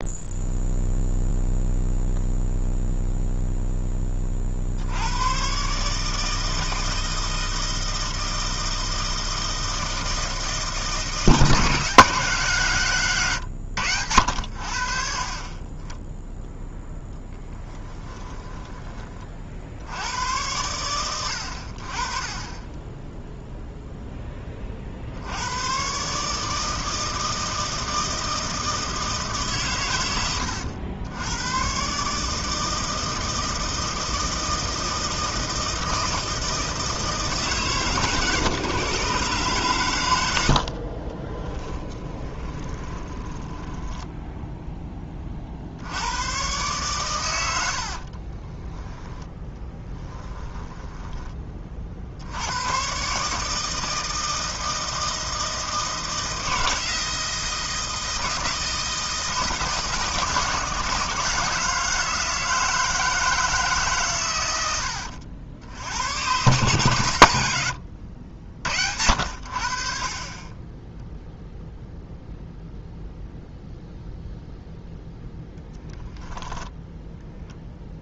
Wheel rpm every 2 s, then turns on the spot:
0, 0, 60, 160, 160, 160, 160, 70, 0, 20, 100, 10, 40, 160, 160, 100, 160, 160, 160, 130, 80, 20, 10, 130, 20, 10, 110, 160, 160, 160, 160, 160, 90, 130, 70, 20, 0, 0, 0.
40-44 48-52